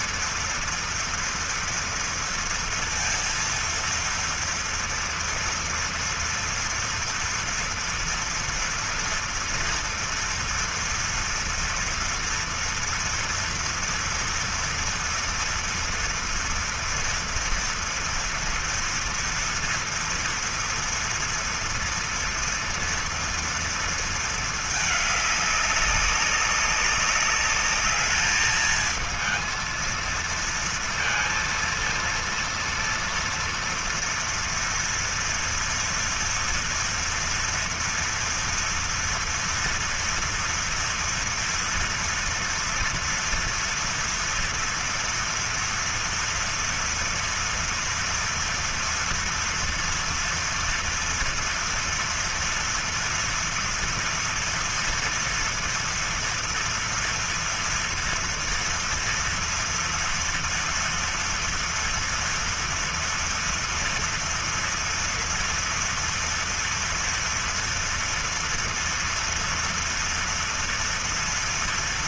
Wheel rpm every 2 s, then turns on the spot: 230, 230, 230, 230, 230, 230, 230, 240, 240, 230, 230, 230, 220, 200, 210, 230, 230, 230, 230, 240, 230, 230, 230, 230, 230, 230, 230, 230, 230, 230, 230, 230, 230, 230, 230, 230.
none